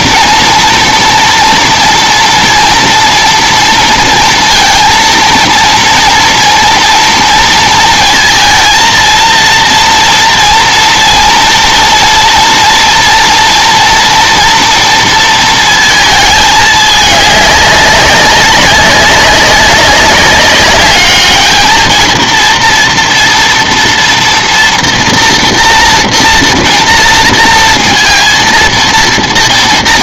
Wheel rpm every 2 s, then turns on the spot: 230, 230, 230, 230, 230, 230, 230, 230, 210, 190, 200, 230, 240, 230, 230.
none